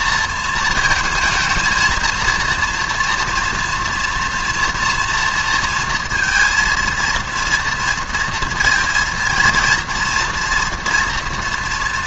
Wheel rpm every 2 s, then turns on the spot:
220, 230, 240, 230, 230, 230.
none